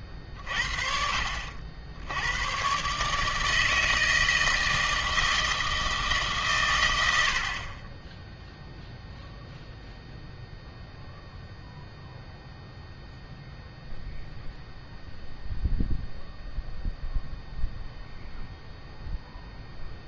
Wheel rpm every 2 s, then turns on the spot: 30, 120, 160, 110, 0, 0, 0, 0, 0, 0.
none